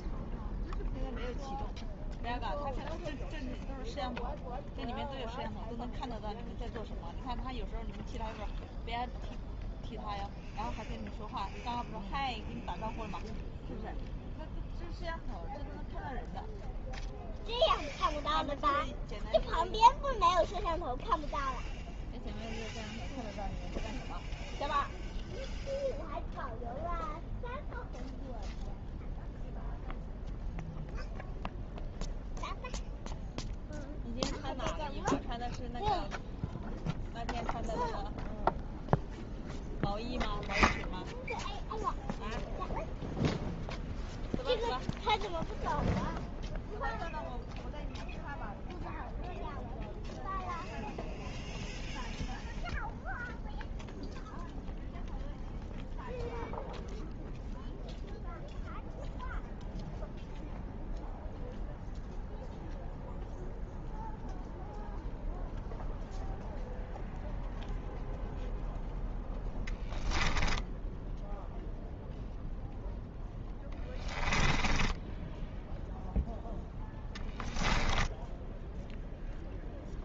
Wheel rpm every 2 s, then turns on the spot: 0, 0, 0, 0, 0, 0, 0, 0, 0, 0, 0, 0, 0, 0, 0, 0, 0, 0, 0, 0, 0, 0, 0, 0, 0, 0, 0, 0, 0, 0, 0, 0, 0, 0, 0, 10, 0, 10, 10, 0.
74-76